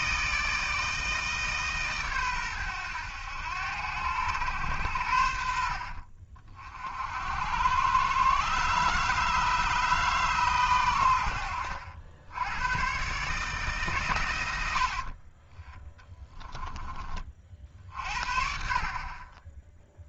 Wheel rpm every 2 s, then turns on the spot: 160, 100, 100, 50, 140, 120, 110, 70, 20, 40.
none